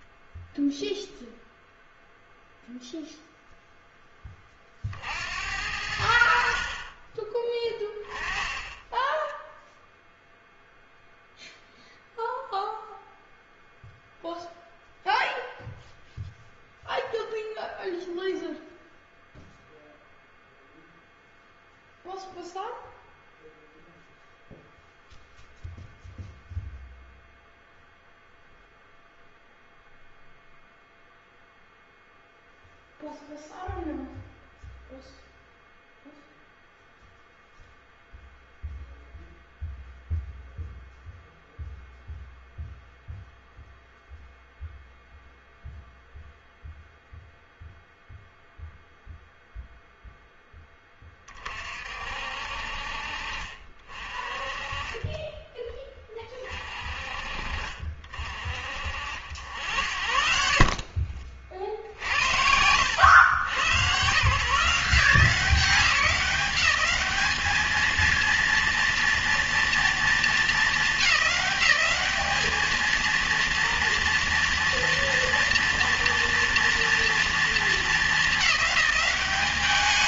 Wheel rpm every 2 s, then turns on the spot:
0, 0, 40, 50, 20, 0, 0, 0, 0, 0, 0, 0, 0, 0, 0, 0, 0, 0, 0, 0, 0, 0, 0, 0, 0, 10, 50, 30, 40, 50, 50, 90, 150, 200, 230, 210, 210, 230, 230, 210.
60-64